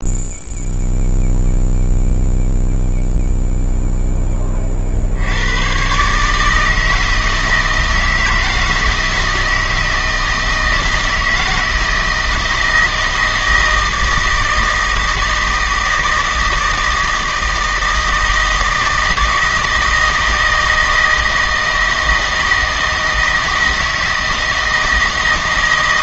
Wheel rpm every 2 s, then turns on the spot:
0, 0, 50, 160, 160, 160, 160, 160, 160, 160, 160, 160, 160.
none